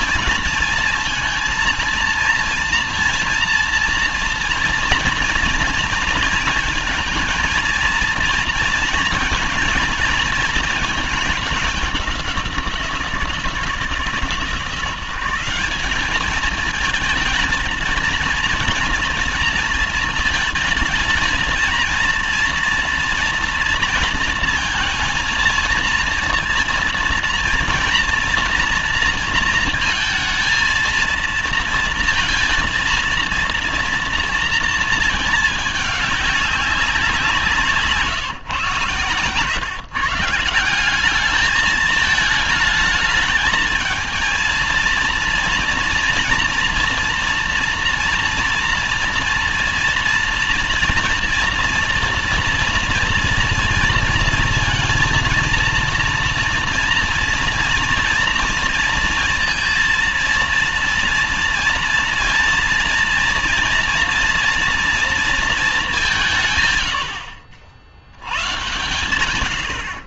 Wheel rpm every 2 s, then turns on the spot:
230, 230, 230, 230, 230, 220, 170, 170, 220, 230, 220, 230, 230, 230, 230, 220, 230, 230, 190, 140, 180, 220, 230, 230, 230, 230, 230, 230, 230, 230, 230, 230, 230, 130, 140.
none